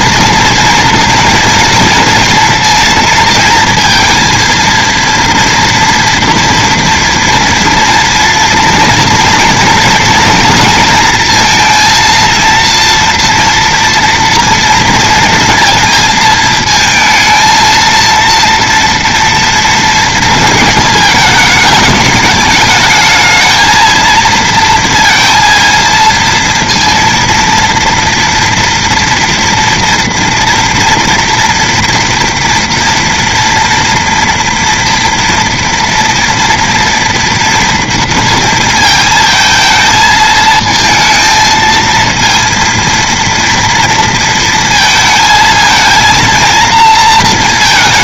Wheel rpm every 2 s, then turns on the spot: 230, 230, 230, 230, 230, 230, 230, 230, 230, 230, 220, 210, 230, 230, 230, 240, 230, 230, 230, 230, 220, 230, 230, 230.
none